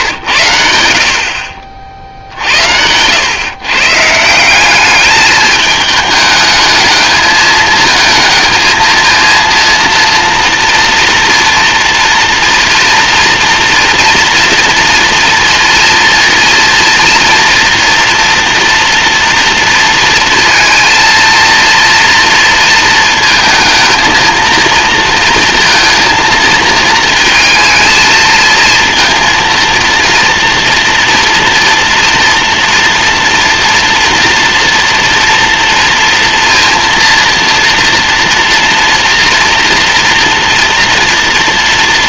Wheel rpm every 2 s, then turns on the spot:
70, 100, 210, 220, 220, 230, 230, 230, 230, 230, 230, 220, 230, 220, 230, 240, 230, 230, 230, 240, 230.
none